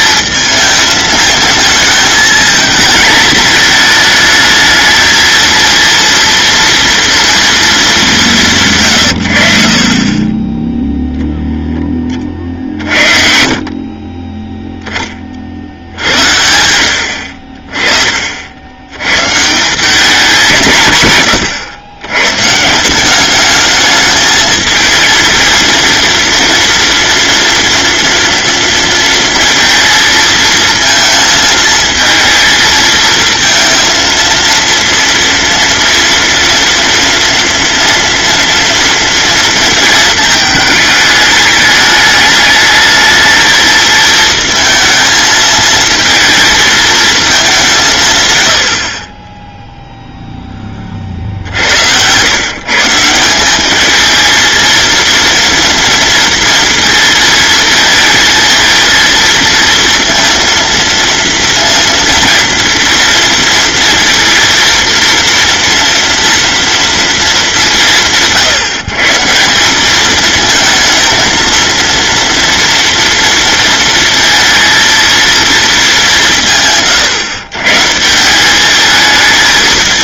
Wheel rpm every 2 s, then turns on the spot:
220, 230, 220, 230, 130, 10, 50, 10, 80, 110, 130, 180, 230, 240, 230, 230, 230, 230, 230, 230, 210, 220, 220, 220, 40, 40, 150, 230, 230, 230, 230, 230, 230, 230, 150, 220, 230, 230, 130, 210.
none